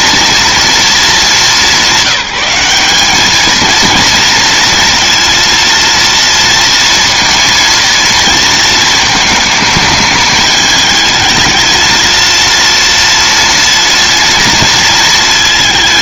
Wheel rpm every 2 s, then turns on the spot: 220, 200, 230, 230, 220, 220, 230, 230.
none